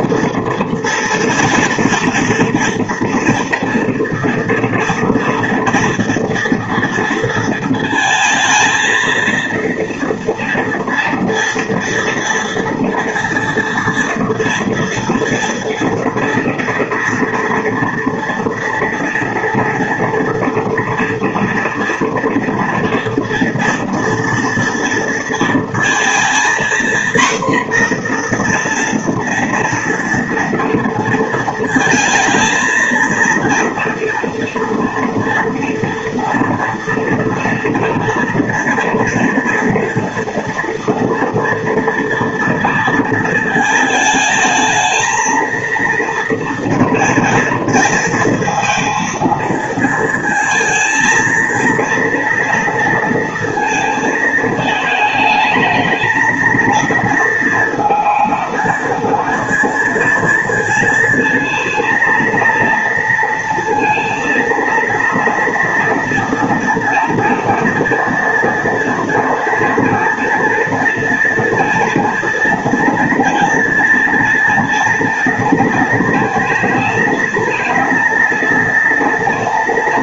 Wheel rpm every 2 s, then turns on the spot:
230, 230, 230, 230, 220, 230, 230, 230, 240, 230, 230, 230, 240, 240, 240, 230, 230, 230, 230, 230, 230, 230, 220, 230, 230, 220, 230, 220, 220, 230, 230, 230, 230, 230, 230, 230, 240, 230, 220, 230.
none